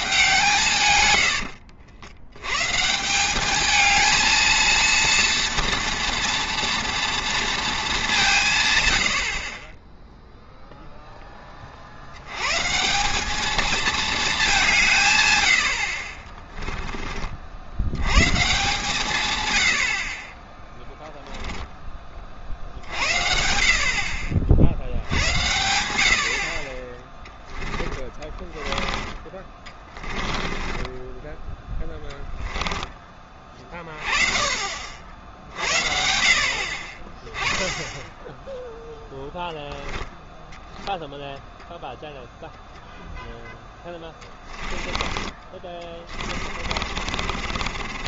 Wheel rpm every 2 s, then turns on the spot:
140, 130, 230, 230, 130, 0, 140, 190, 20, 150, 10, 50, 60, 40, 20, 20, 10, 40, 50, 0, 0, 0, 20, 40.
16-18 28-32 44-48